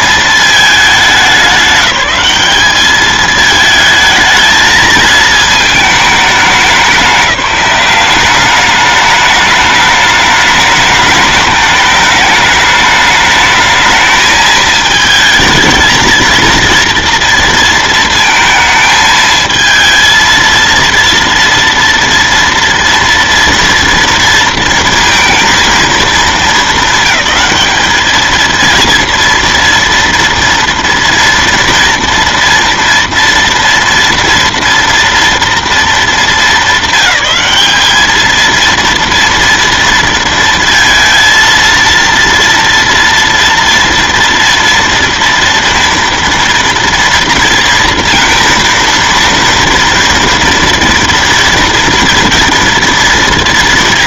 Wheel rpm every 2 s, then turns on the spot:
220, 210, 220, 200, 200, 210, 210, 220, 230, 220, 230, 230, 230, 200, 230, 230, 230, 230, 220, 230, 230, 230, 240, 230, 230, 230, 230.
none